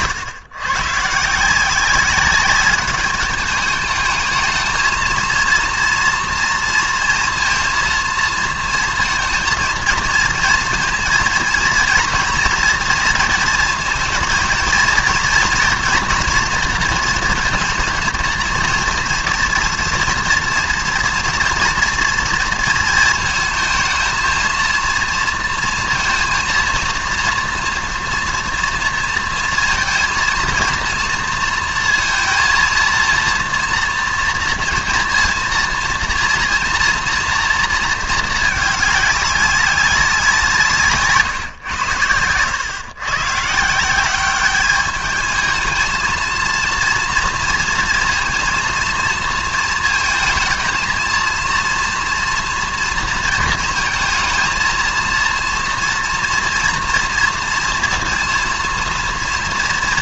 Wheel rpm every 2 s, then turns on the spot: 130, 200, 220, 230, 220, 230, 240, 230, 230, 230, 230, 230, 230, 230, 230, 230, 230, 240, 230, 220, 180, 100, 200, 230, 230, 220, 230, 230, 240, 230.
none